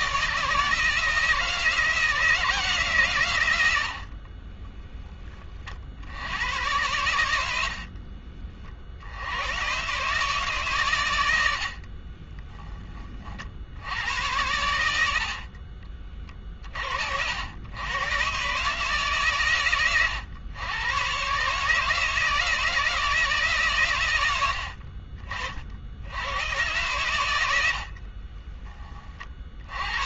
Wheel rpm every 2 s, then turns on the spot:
160, 160, 30, 90, 50, 130, 20, 90, 50, 140, 110, 160, 70, 110, 20.
4-6